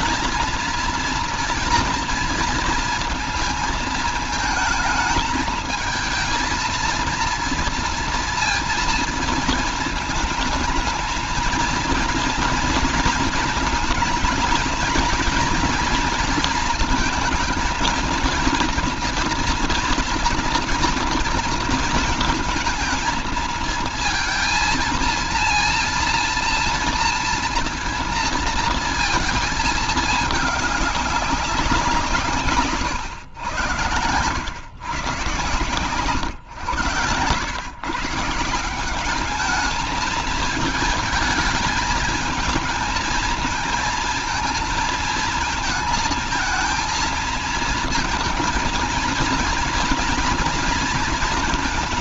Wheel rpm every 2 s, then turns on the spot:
230, 230, 220, 230, 240, 220, 230, 220, 230, 230, 230, 230, 230, 230, 230, 210, 160, 120, 130, 160, 220, 220, 230, 230, 230, 230.
32-34